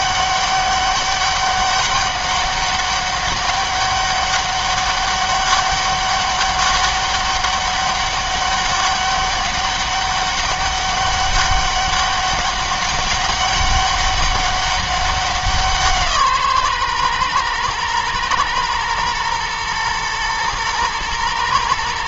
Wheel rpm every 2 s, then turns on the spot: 200, 200, 200, 200, 200, 200, 200, 200, 130, 110, 110.
none